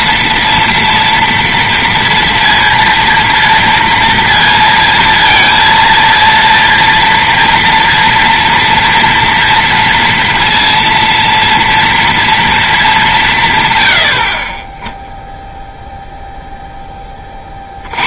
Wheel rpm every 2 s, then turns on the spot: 240, 230, 230, 230, 230, 230, 220, 10, 0.
none